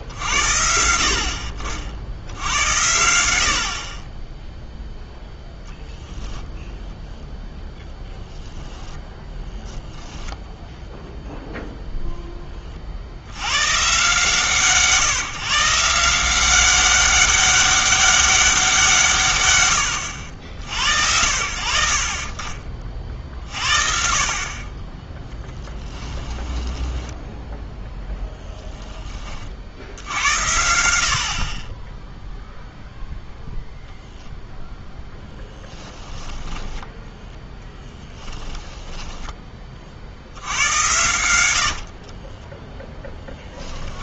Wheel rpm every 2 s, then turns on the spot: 60, 90, 0, 0, 10, 0, 40, 140, 190, 170, 70, 40, 20, 10, 10, 70, 0, 0, 10, 10, 80, 0.
8-10 26-28 36-42